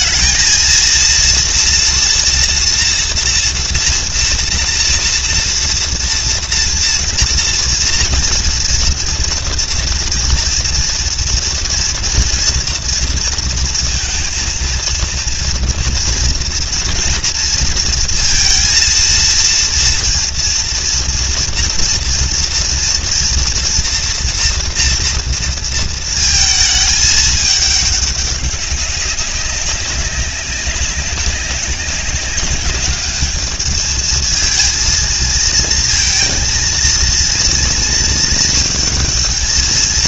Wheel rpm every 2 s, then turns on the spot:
230, 240, 230, 230, 240, 240, 230, 230, 230, 230, 230, 230, 230, 220, 190, 190, 210, 230, 230, 220.
none